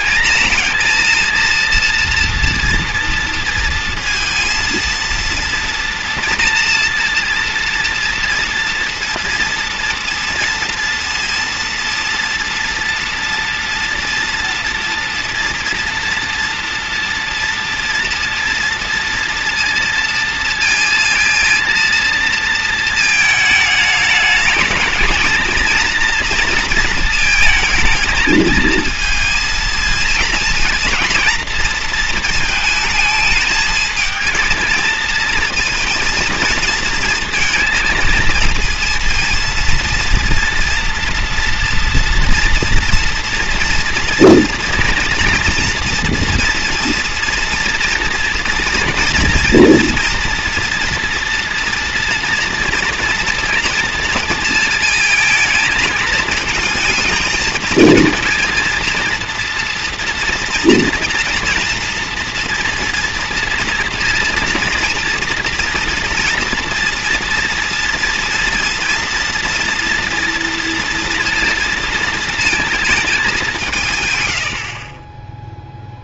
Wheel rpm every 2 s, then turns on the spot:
230, 230, 230, 230, 230, 230, 230, 230, 230, 230, 230, 230, 220, 230, 220, 230, 220, 220, 230, 230, 230, 230, 240, 230, 230, 230, 230, 230, 220, 230, 230, 230, 230, 230, 230, 230, 230, 60.
74-76